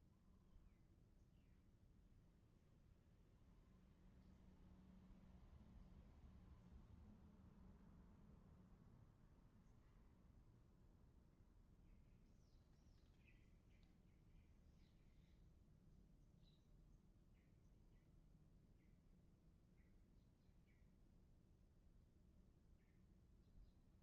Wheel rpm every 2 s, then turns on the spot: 0, 0, 0, 0, 0, 0, 0, 0, 0, 0, 0, 0.
none